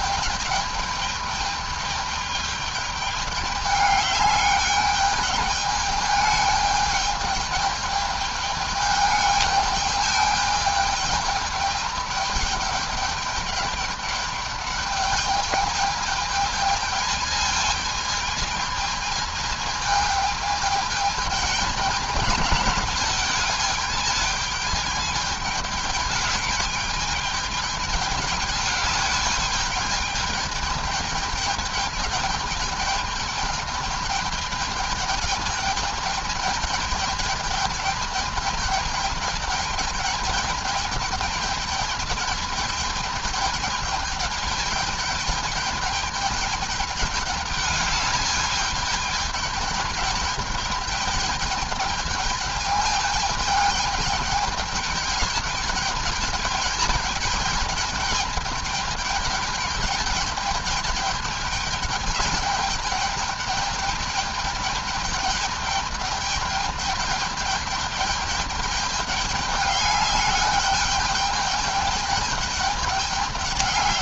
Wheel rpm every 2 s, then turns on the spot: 210, 210, 210, 210, 210, 210, 210, 210, 210, 220, 220, 210, 210, 210, 210, 210, 210, 210, 210, 220, 210, 210, 210, 210, 210, 210, 210, 210, 210, 210, 210, 210, 210, 210, 210, 200, 210.
none